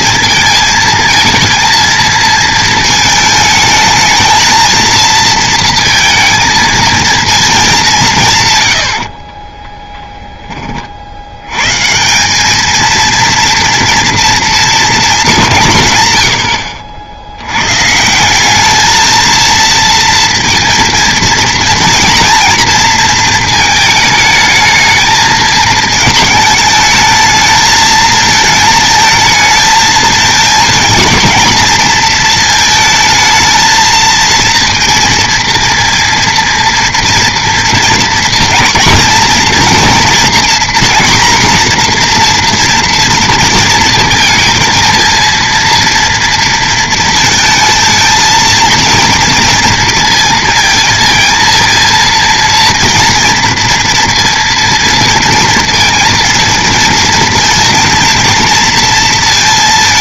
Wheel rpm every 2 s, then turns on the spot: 230, 230, 220, 220, 120, 30, 210, 230, 70, 210, 230, 230, 220, 220, 220, 230, 220, 230, 230, 240, 240, 240, 230, 230, 230, 230, 230, 230, 230, 230.
none